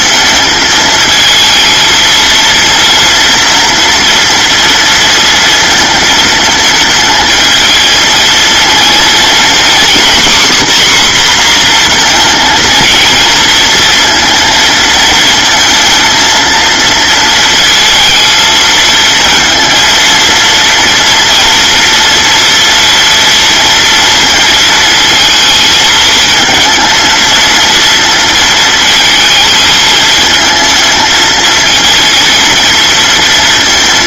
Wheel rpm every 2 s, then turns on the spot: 230, 230, 230, 220, 230, 270, 230, 220, 230, 230, 230, 230, 220, 230, 220, 220, 230.
none